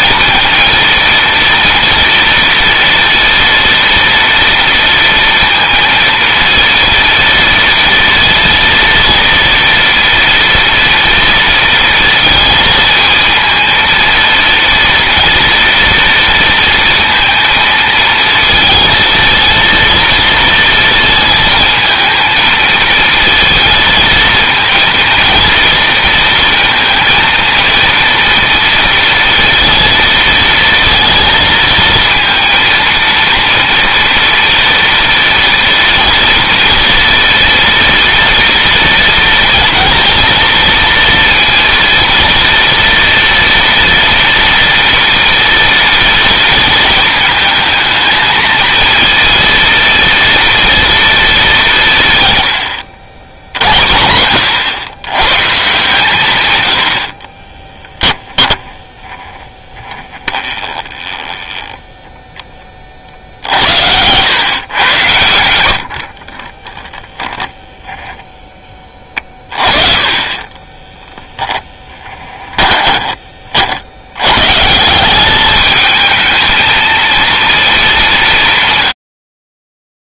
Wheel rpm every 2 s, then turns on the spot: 230, 230, 230, 230, 230, 230, 230, 230, 230, 230, 230, 230, 230, 230, 230, 230, 230, 230, 240, 230, 230, 230, 240, 220, 230, 230, 70, 90, 70, 10, 20, 30, 110, 10, 20, 10, 20, 160, 230, 110.
60-62 66-74